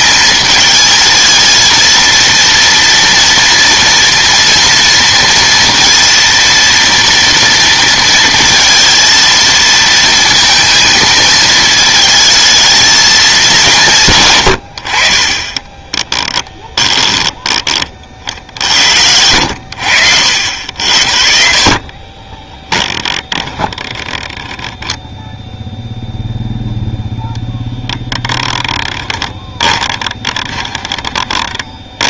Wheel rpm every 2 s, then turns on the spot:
220, 230, 230, 230, 230, 220, 220, 60, 20, 70, 60, 10, 10, 0, 10, 20.
16-18 22-24 28-32